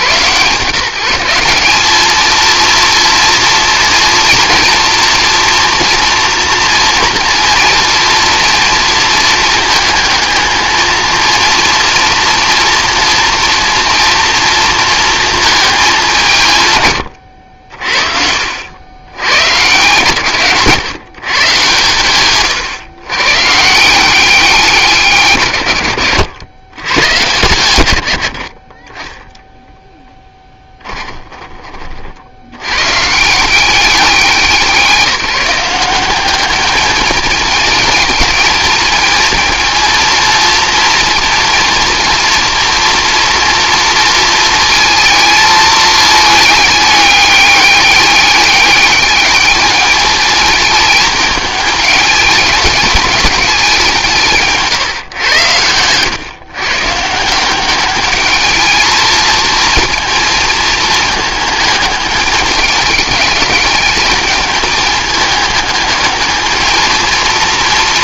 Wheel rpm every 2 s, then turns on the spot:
160, 230, 230, 230, 230, 230, 230, 230, 130, 80, 140, 120, 180, 110, 40, 20, 100, 190, 210, 220, 230, 230, 220, 210, 200, 210, 210, 150, 140, 210, 220, 210, 210, 230.
30-32